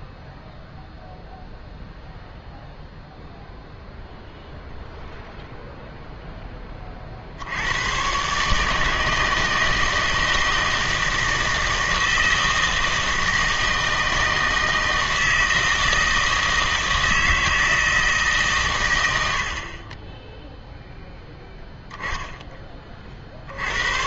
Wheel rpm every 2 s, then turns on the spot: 0, 0, 0, 20, 150, 160, 160, 160, 160, 120, 0, 20.
none